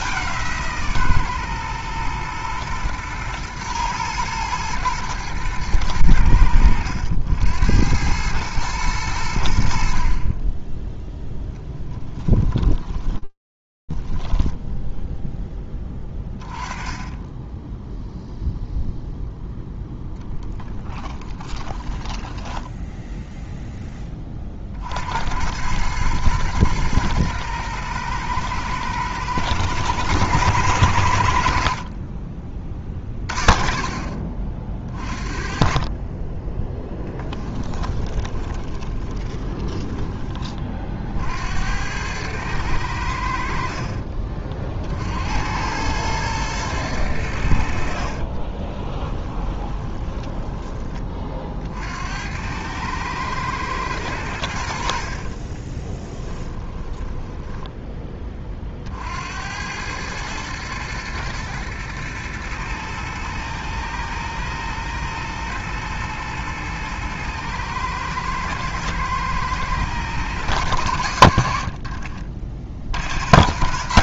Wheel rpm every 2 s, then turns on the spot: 180, 120, 110, 90, 110, 30, 10, 0, 20, 0, 10, 10, 60, 110, 110, 90, 30, 40, 10, 20, 50, 90, 60, 100, 20, 20, 110, 60, 10, 40, 110, 120, 120, 120, 110, 100, 60.
12-14 20-22 36-40 48-50 54-58